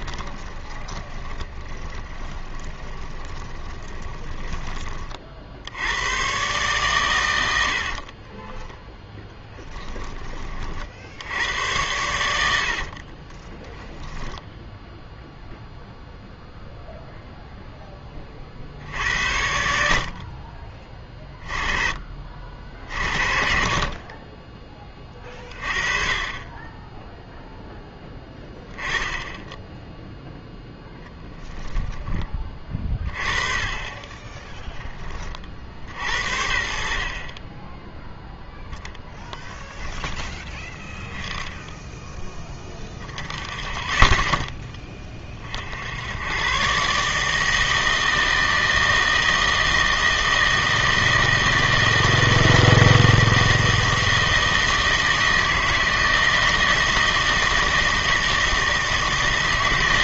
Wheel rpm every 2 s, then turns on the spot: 30, 20, 20, 130, 10, 50, 60, 0, 0, 50, 40, 50, 20, 20, 10, 0, 20, 10, 50, 10, 10, 10, 10, 130, 160, 160, 160, 160, 160, 160.
0-4 12-14